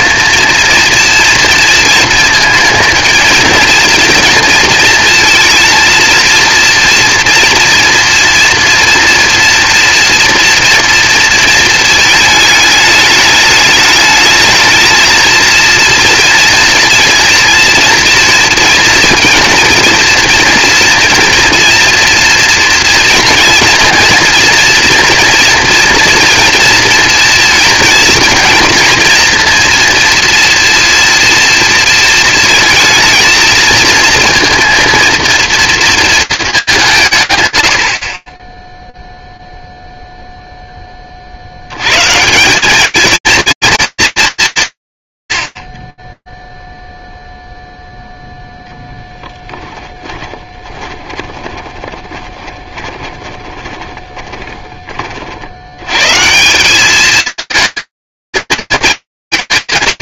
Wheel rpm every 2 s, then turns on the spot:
230, 220, 230, 230, 240, 230, 220, 220, 230, 230, 230, 230, 230, 230, 230, 230, 220, 230, 210, 10, 20, 210, 150, 0, 0, 20, 20, 40, 210, 230.
50-54